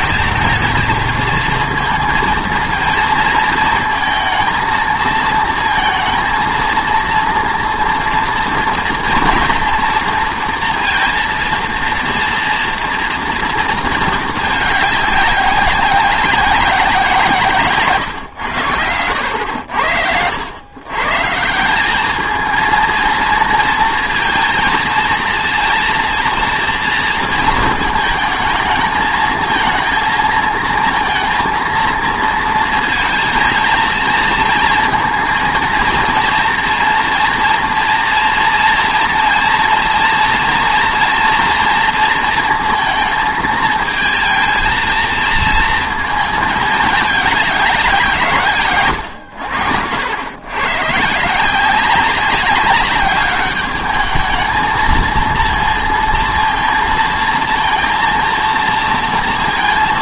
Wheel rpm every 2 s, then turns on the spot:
220, 230, 230, 230, 230, 230, 230, 210, 180, 110, 120, 230, 230, 230, 220, 220, 230, 230, 230, 230, 230, 220, 220, 220, 130, 130, 200, 220, 230, 230.
none